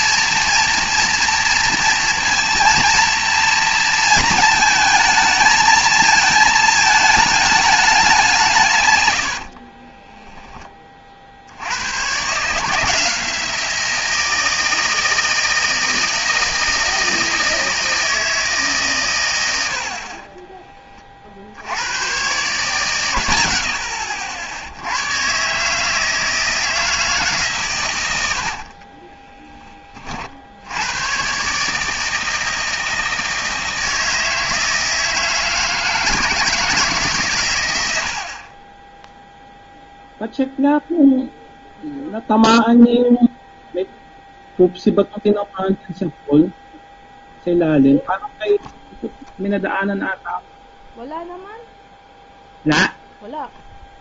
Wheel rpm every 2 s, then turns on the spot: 230, 230, 220, 220, 130, 20, 160, 160, 160, 140, 30, 140, 90, 160, 30, 100, 160, 160, 150, 10, 0, 0, 0, 0, 0, 0, 0.
28-30